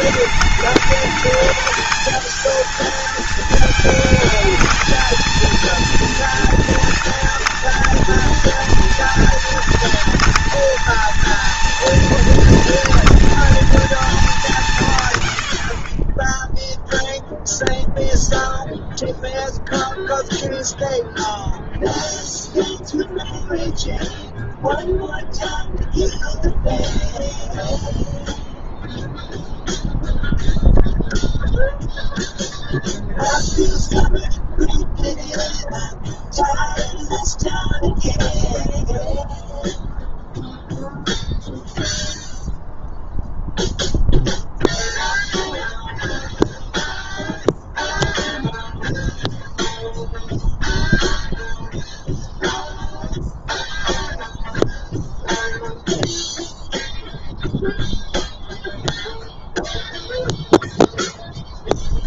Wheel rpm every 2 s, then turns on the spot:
210, 220, 230, 230, 230, 230, 230, 100, 0, 0, 0, 0, 0, 0, 0, 0, 0, 0, 0, 0, 0, 0, 0, 0, 0, 0, 0, 0, 0, 0, 0.
none